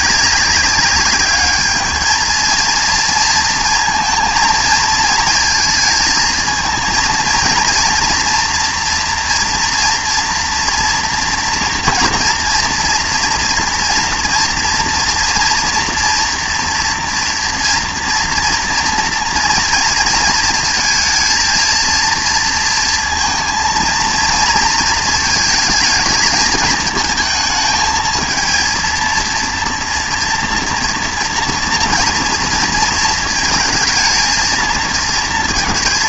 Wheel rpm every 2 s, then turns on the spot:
200, 230, 230, 230, 230, 230, 230, 230, 230, 230, 230, 230, 230, 220, 230, 230, 230, 230.
none